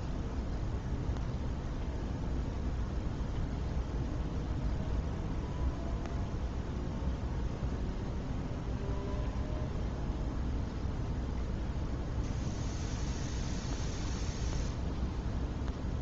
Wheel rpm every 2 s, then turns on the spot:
0, 0, 0, 0, 0, 0, 0, 0.
none